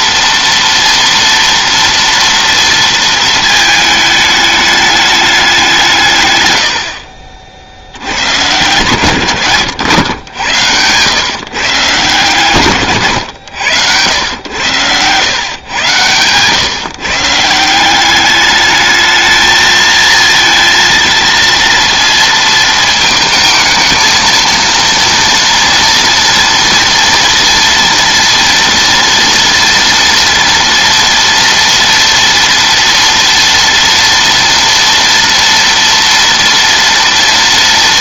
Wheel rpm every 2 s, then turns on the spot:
230, 230, 210, 70, 120, 100, 120, 100, 140, 210, 230, 220, 230, 230, 230, 230, 230, 240, 230.
none